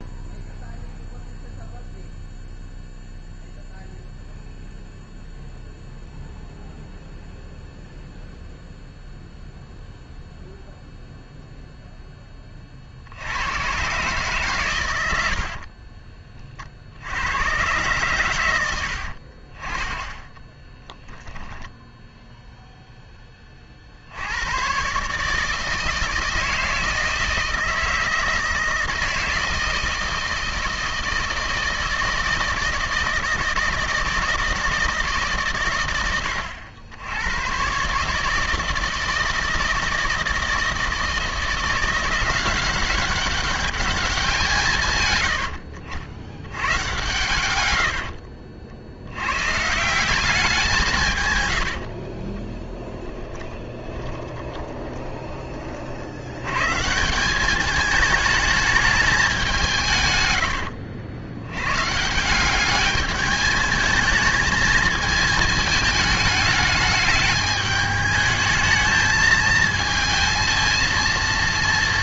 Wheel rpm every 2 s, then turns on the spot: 0, 0, 0, 0, 0, 0, 50, 100, 70, 60, 10, 0, 120, 160, 160, 160, 160, 160, 100, 160, 160, 190, 160, 90, 90, 170, 10, 20, 160, 210, 60, 210, 220, 210, 220, 230.
18-22 52-54